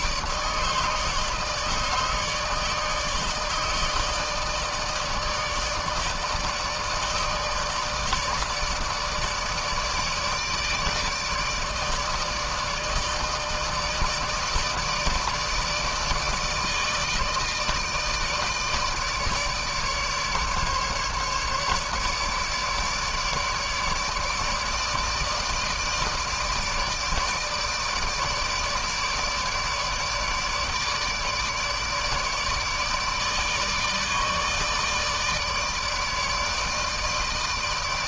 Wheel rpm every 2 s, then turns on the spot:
150, 150, 150, 160, 160, 150, 160, 160, 160, 160, 150, 150, 150, 150, 150, 150, 150, 150, 160.
none